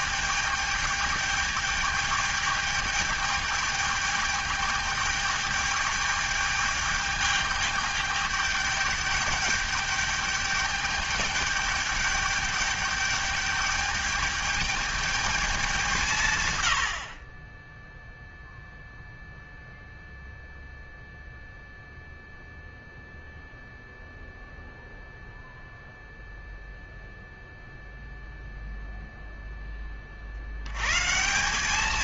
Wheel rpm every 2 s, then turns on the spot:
210, 210, 210, 210, 210, 210, 210, 210, 80, 0, 0, 0, 0, 0, 0, 120.
none